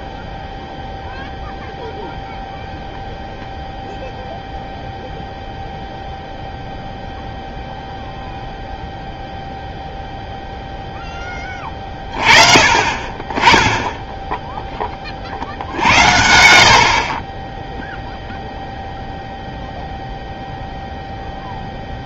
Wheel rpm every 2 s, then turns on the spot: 0, 0, 0, 0, 0, 0, 30, 20, 60, 0, 0.
none